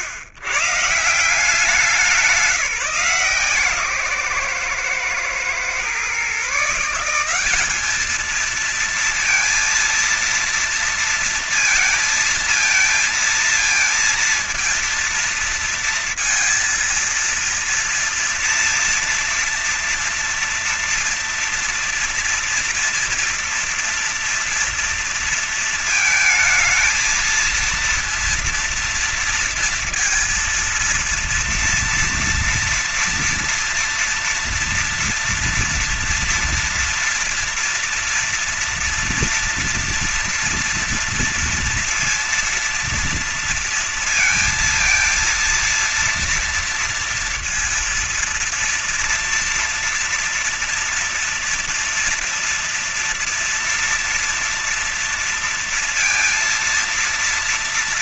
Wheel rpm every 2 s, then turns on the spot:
120, 160, 130, 140, 220, 230, 230, 230, 230, 240, 240, 240, 230, 220, 230, 230, 230, 230, 230, 230, 230, 230, 230, 230, 240, 230, 230, 230, 230.
none